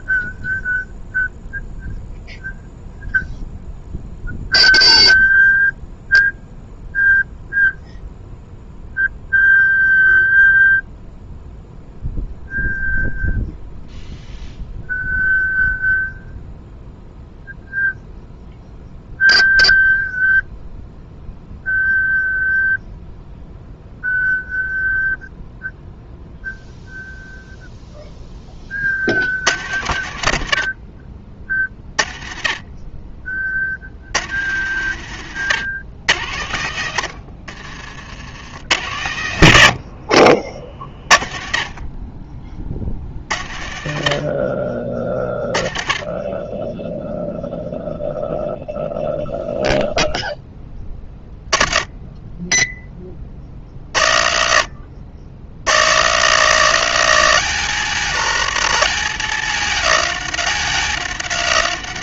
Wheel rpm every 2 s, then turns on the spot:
0, 0, 0, 0, 0, 0, 0, 0, 0, 0, 0, 0, 0, 0, 60, 50, 30, 100, 70, 90, 30, 60, 30, 0, 0, 10, 20, 60, 130, 130, 130.
none